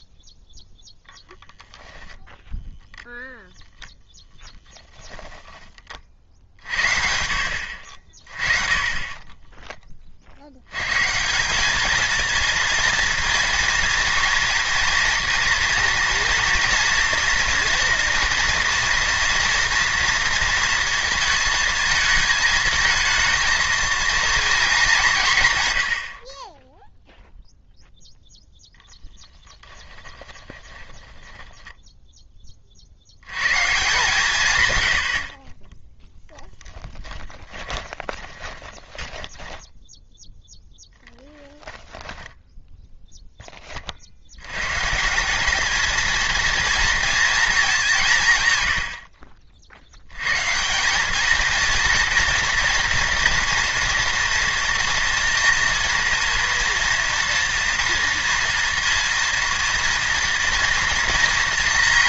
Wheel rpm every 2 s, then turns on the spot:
0, 0, 10, 60, 30, 110, 230, 230, 230, 230, 230, 220, 210, 0, 10, 10, 40, 100, 10, 20, 0, 0, 130, 230, 80, 170, 240, 230, 230, 230, 230.
4-6 8-10 28-32 36-40 48-50